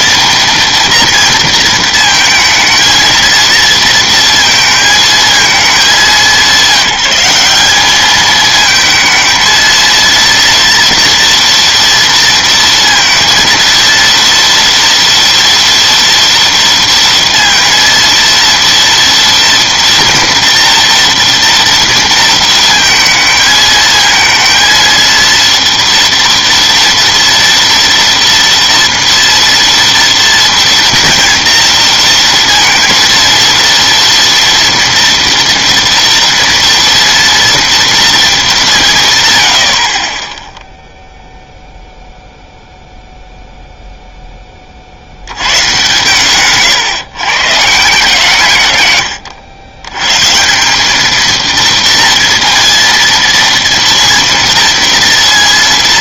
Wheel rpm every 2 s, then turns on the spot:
230, 230, 230, 190, 220, 230, 230, 230, 230, 230, 230, 230, 230, 230, 230, 240, 230, 230, 230, 180, 0, 0, 30, 140, 120, 180, 230, 230.
none